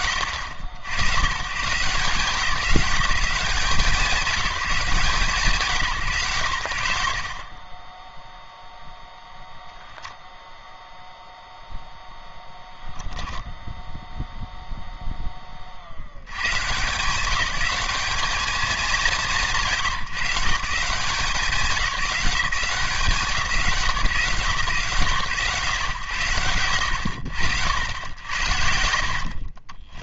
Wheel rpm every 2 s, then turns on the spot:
90, 180, 170, 30, 0, 0, 0, 0, 160, 180, 170, 160, 130, 80, 60.
none